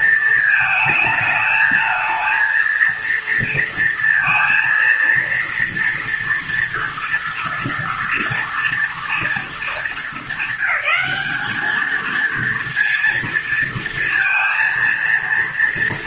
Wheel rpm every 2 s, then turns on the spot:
220, 230, 230, 230, 230, 200, 230, 230.
none